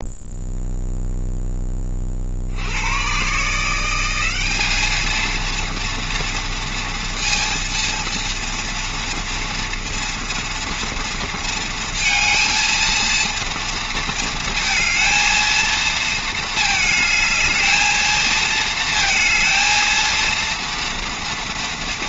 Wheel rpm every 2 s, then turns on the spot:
0, 100, 210, 230, 230, 230, 230, 220, 220, 220, 230.
none